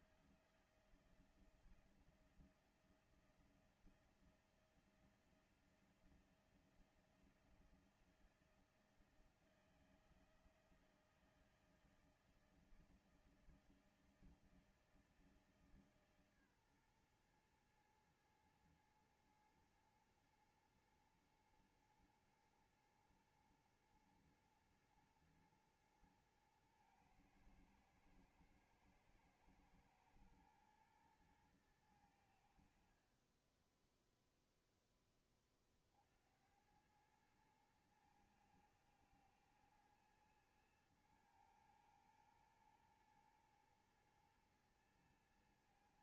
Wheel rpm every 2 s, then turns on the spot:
170, 170, 170, 170, 170, 160, 160, 160, 130, 110, 110, 110, 120, 110, 110, 110, 70, 0, 80, 110, 110, 120, 120.
none